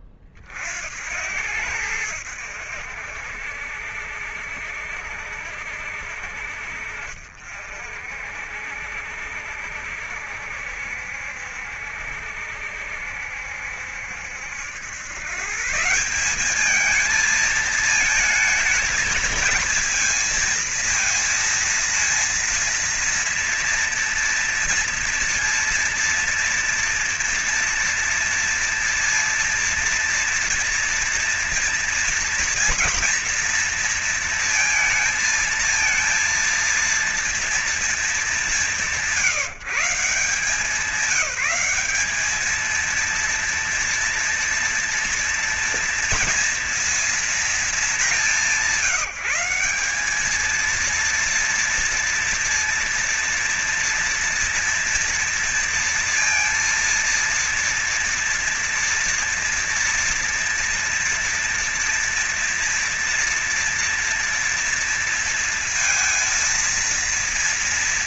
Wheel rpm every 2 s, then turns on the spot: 40, 70, 70, 60, 60, 60, 70, 80, 200, 220, 230, 230, 230, 230, 230, 230, 230, 230, 230, 190, 180, 220, 240, 230, 200, 220, 230, 230, 230, 230, 230, 240, 230, 230.
none